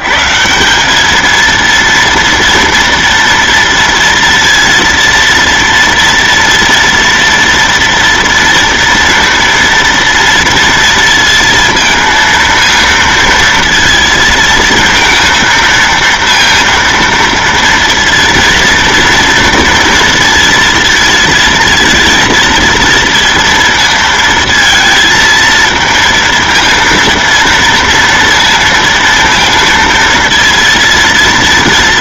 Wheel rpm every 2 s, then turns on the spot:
170, 230, 230, 230, 230, 230, 230, 230, 230, 230, 230, 230, 230, 230, 230, 230.
none